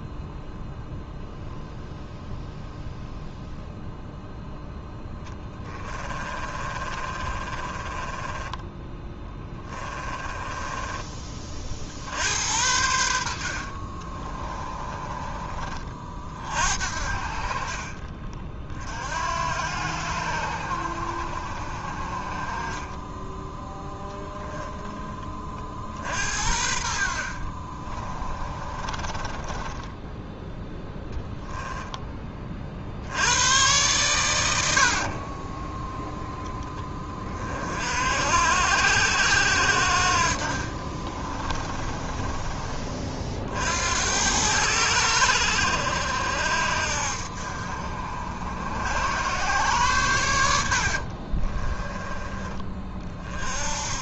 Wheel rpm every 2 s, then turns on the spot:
0, 0, 0, 30, 20, 20, 80, 30, 50, 50, 70, 30, 10, 60, 30, 0, 40, 90, 10, 70, 50, 30, 90, 60, 80, 80, 30.
6-12 14-16 28-30 34-36 40-42